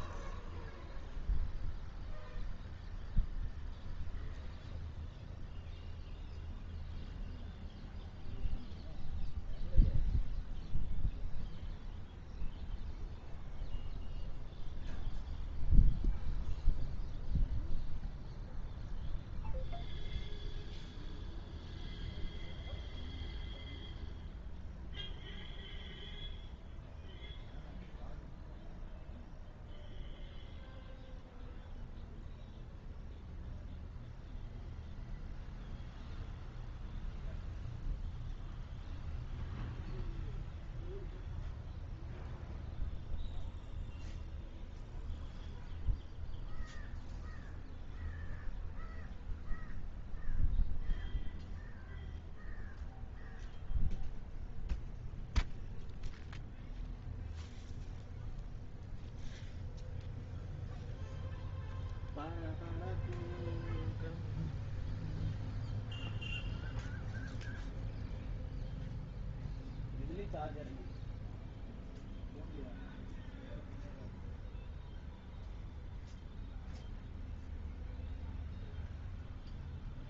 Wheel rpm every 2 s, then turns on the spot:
0, 0, 0, 0, 0, 0, 0, 0, 0, 0, 0, 0, 0, 0, 0, 0, 0, 0, 0, 0, 0, 0, 0, 0, 0, 0, 0, 0, 0, 0, 0, 0, 0, 0, 0, 0, 0, 0, 0, 0.
none